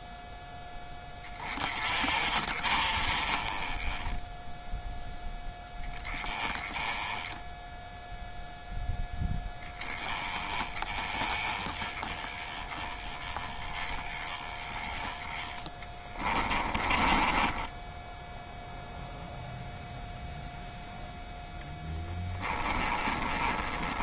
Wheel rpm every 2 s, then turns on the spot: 10, 30, 0, 10, 0, 20, 20, 10, 20, 0, 0, 20.
16-18 22-24